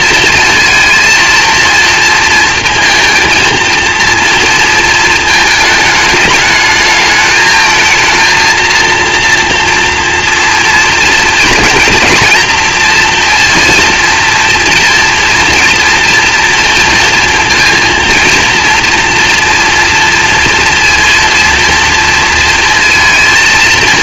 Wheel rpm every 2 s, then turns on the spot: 220, 230, 230, 220, 230, 230, 230, 240, 230, 230, 230, 230.
none